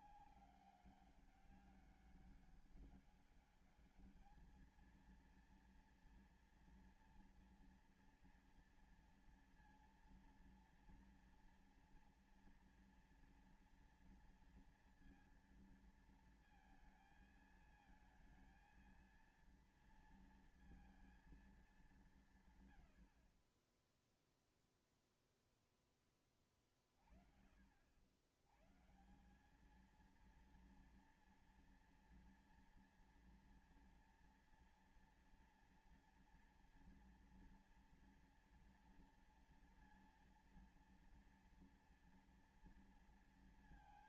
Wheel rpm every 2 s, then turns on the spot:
200, 200, 210, 230, 230, 230, 230, 230, 230, 220, 230, 140, 0, 30, 110, 230, 230, 230, 230, 230, 230, 230.
none